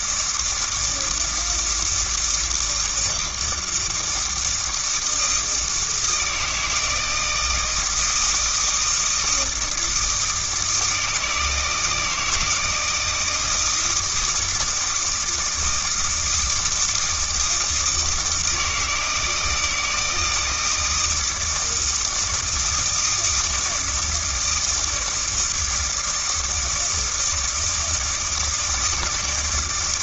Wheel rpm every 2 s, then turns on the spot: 160, 160, 160, 170, 160, 160, 160, 160, 160, 160, 160, 160, 160, 160, 160.
none